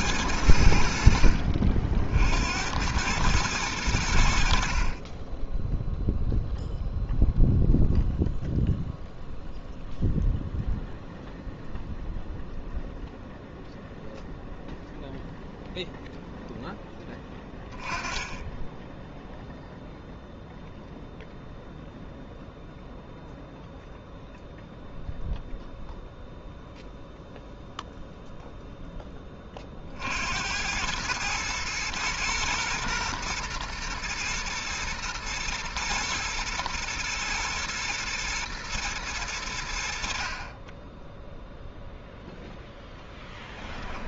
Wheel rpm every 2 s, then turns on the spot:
80, 80, 60, 0, 0, 0, 0, 0, 0, 10, 0, 0, 0, 0, 0, 90, 120, 110, 110, 110, 20, 0.
none